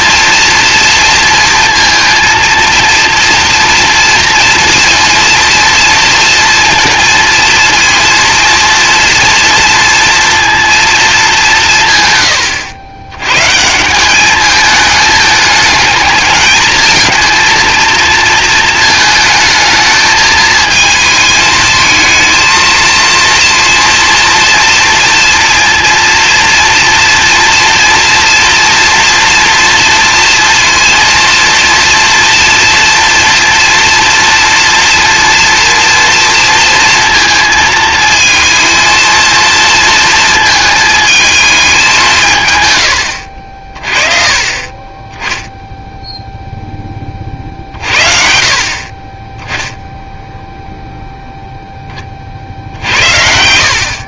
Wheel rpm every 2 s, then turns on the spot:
230, 230, 230, 230, 240, 230, 100, 210, 220, 220, 220, 230, 230, 230, 230, 230, 230, 230, 230, 230, 220, 110, 30, 0, 50, 0, 70.
none